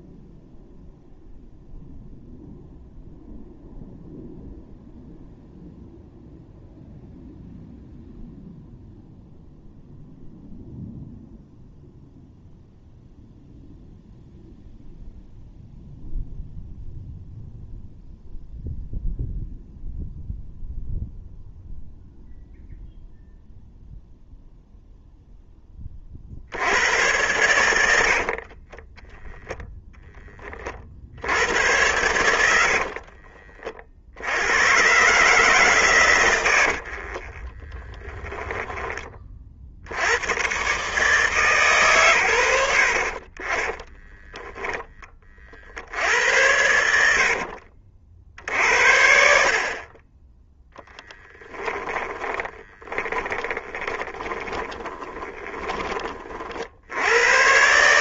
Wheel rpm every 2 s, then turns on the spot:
0, 0, 0, 0, 0, 0, 0, 0, 0, 0, 0, 0, 0, 80, 20, 40, 60, 110, 80, 10, 130, 80, 10, 80, 70, 10, 30, 20, 60.
32-34 36-38 52-56